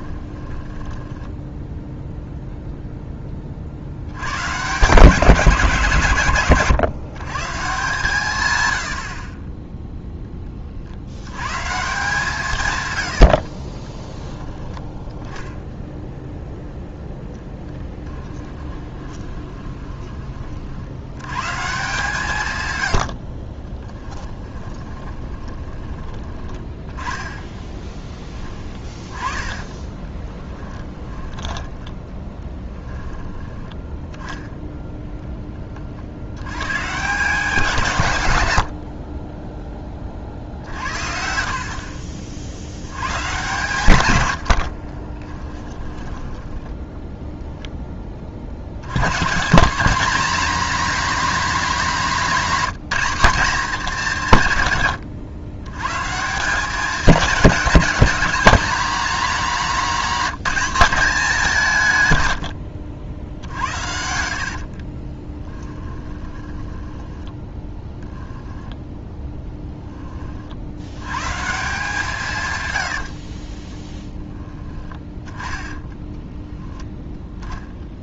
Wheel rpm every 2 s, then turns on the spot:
10, 0, 140, 130, 90, 50, 120, 10, 0, 20, 70, 110, 20, 20, 20, 10, 20, 10, 110, 70, 60, 90, 60, 10, 90, 230, 210, 120, 180, 200, 200, 80, 40, 10, 10, 80, 100, 10, 0.
0-2 12-14 18-20 22-34 38-42 44-46 62-68 72-74